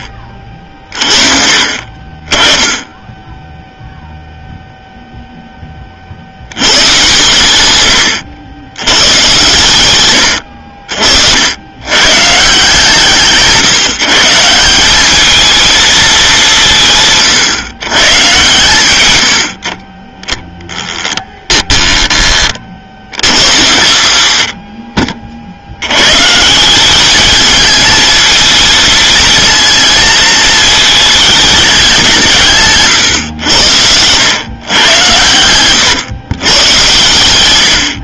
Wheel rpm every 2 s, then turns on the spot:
50, 10, 0, 120, 100, 60, 150, 180, 180, 130, 10, 40, 70, 170, 230, 220, 160, 110, 120.
none